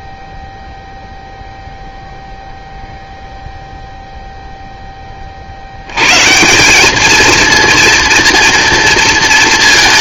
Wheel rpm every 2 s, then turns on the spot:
0, 0, 20, 210, 230.
none